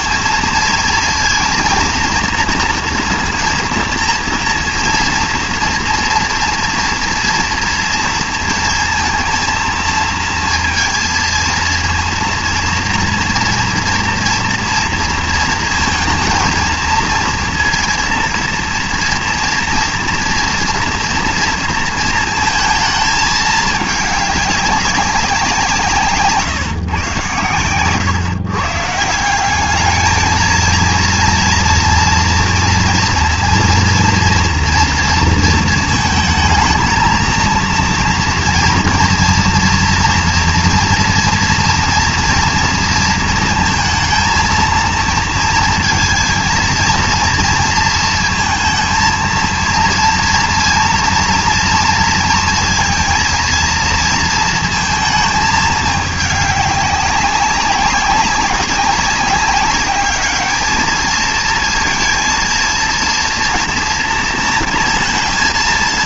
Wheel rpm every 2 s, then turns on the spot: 230, 230, 230, 230, 230, 230, 230, 230, 220, 230, 240, 220, 200, 150, 140, 220, 230, 230, 230, 230, 230, 230, 230, 230, 230, 230, 230, 230, 200, 200, 210, 230, 230.
none